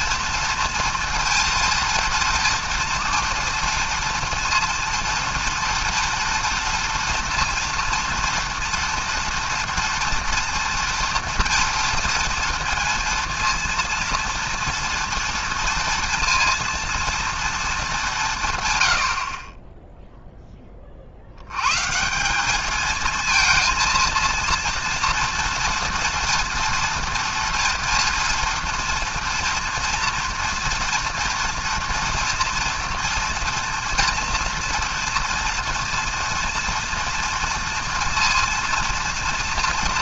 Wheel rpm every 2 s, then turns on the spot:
230, 230, 230, 230, 240, 240, 230, 230, 230, 50, 90, 230, 230, 230, 230, 230, 230, 230, 230, 230.
none